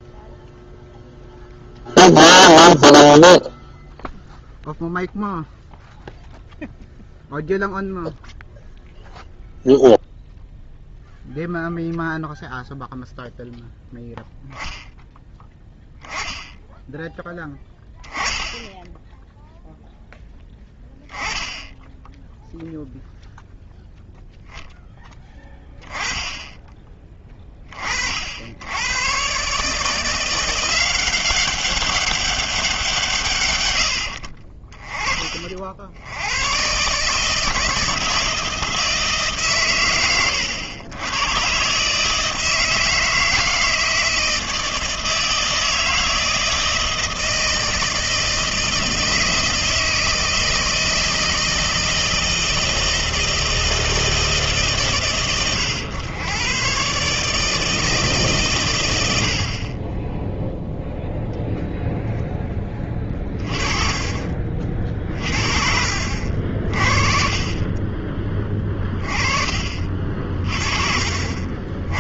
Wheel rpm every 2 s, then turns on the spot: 0, 0, 0, 0, 0, 0, 0, 0, 10, 10, 10, 0, 10, 20, 90, 180, 190, 30, 120, 160, 110, 160, 160, 160, 160, 160, 160, 150, 120, 120, 0, 10, 50, 60, 20, 40.
68-70